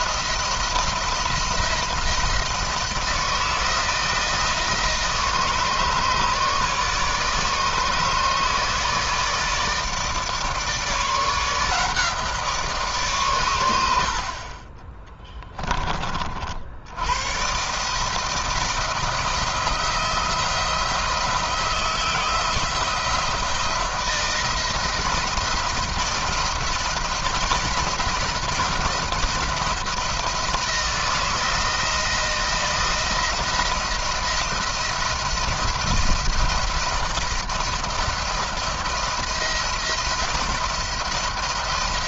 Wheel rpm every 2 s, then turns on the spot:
170, 170, 160, 150, 160, 160, 140, 30, 80, 160, 160, 170, 170, 170, 170, 160, 170, 170, 170, 170, 170.
14-16